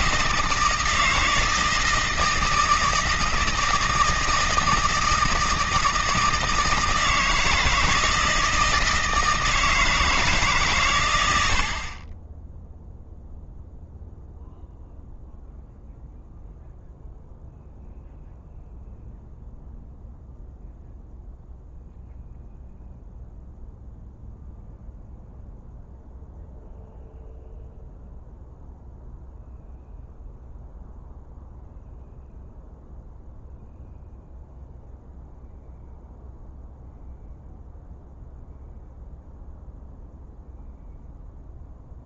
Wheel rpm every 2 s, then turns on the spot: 160, 160, 160, 160, 160, 120, 10, 0, 0, 0, 0, 0, 0, 0, 0, 0, 0, 0, 0, 0, 0.
none